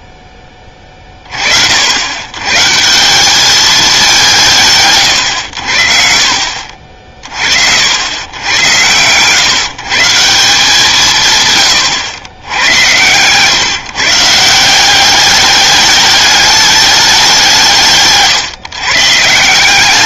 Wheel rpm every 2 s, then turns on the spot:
20, 140, 160, 60, 100, 170, 90, 170, 210, 140.
none